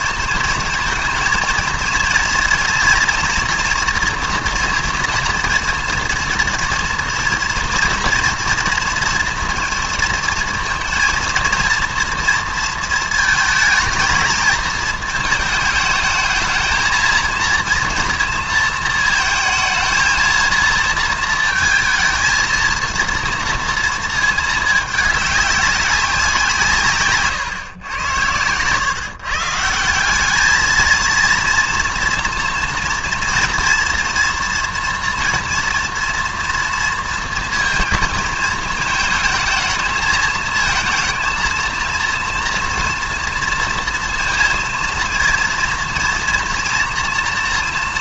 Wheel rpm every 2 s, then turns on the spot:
220, 230, 240, 230, 230, 230, 230, 230, 220, 230, 230, 230, 220, 170, 110, 220, 230, 230, 230, 220, 220, 230, 230, 230.
none